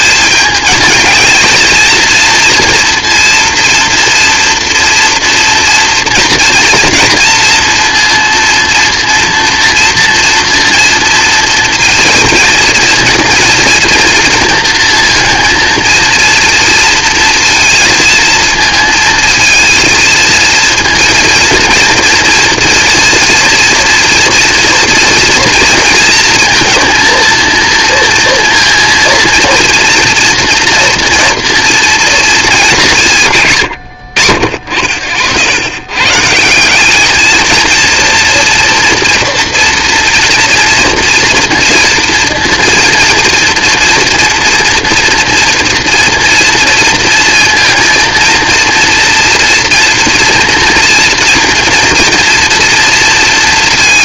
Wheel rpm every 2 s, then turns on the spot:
220, 230, 230, 230, 230, 230, 230, 230, 230, 230, 230, 240, 230, 230, 230, 240, 180, 70, 190, 230, 230, 230, 230, 230, 230, 230, 230.
none